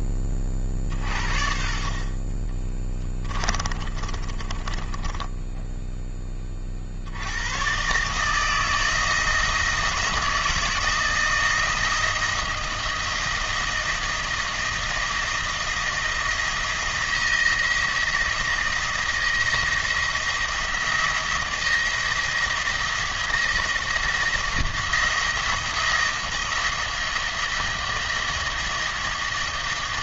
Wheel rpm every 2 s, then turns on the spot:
50, 20, 20, 60, 160, 160, 170, 170, 170, 160, 170, 170, 170, 160, 170.
2-6